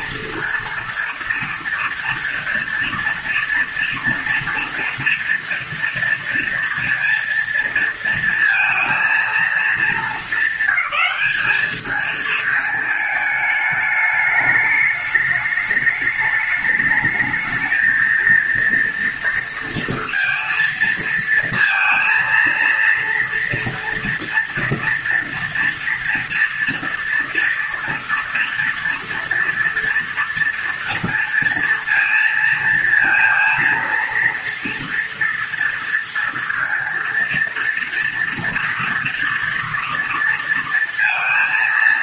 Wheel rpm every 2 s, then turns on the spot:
230, 230, 230, 230, 230, 200, 220, 210, 210, 230, 230, 230, 230, 230, 230, 230, 230, 230, 230, 230, 230.
none